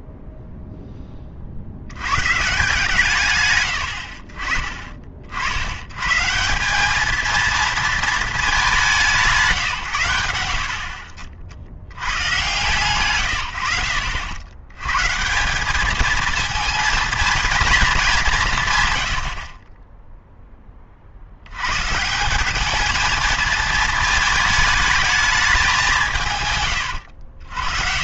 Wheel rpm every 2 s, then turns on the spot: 0, 150, 30, 180, 200, 70, 150, 110, 220, 130, 20, 210, 210, 120.
none